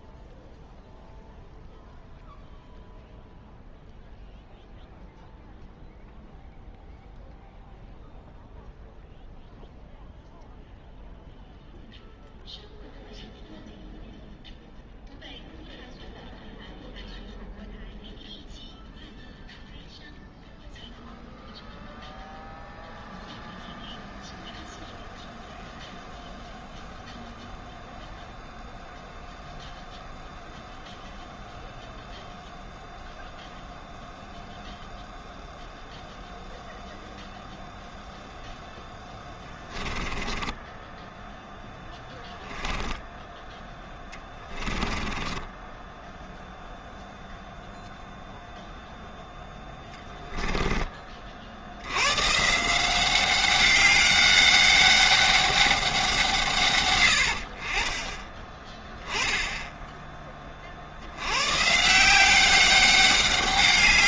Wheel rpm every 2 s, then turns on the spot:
0, 0, 0, 0, 0, 0, 0, 0, 0, 0, 0, 0, 0, 0, 0, 0, 0, 0, 0, 0, 10, 10, 20, 0, 0, 20, 170, 200, 140, 20, 40, 190.
40-46 50-52